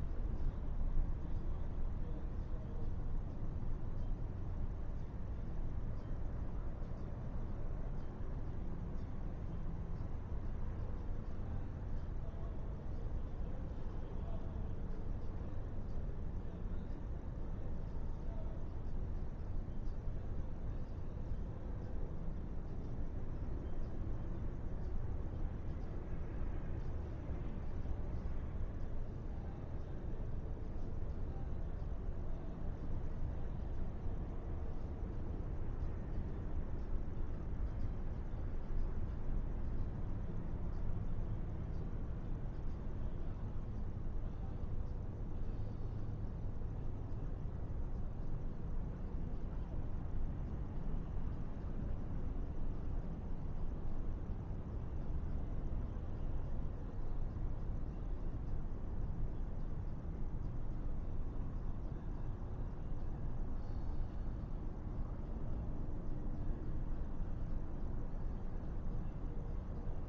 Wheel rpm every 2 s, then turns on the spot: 0, 0, 0, 0, 0, 0, 0, 0, 0, 0, 0, 0, 0, 0, 0, 0, 0, 0, 0, 0, 0, 0, 0, 0, 0, 0, 0, 0, 0, 0, 0, 0, 0, 0, 0.
none